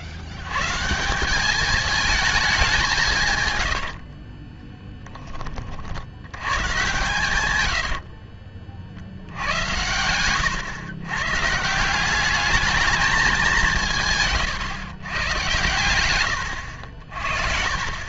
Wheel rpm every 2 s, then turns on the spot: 140, 190, 20, 120, 50, 120, 210, 130, 80.
4-6